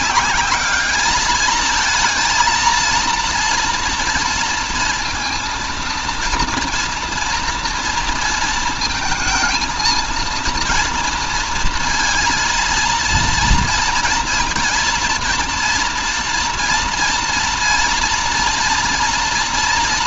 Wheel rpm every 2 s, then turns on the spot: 210, 230, 230, 230, 230, 230, 230, 230, 240, 230.
none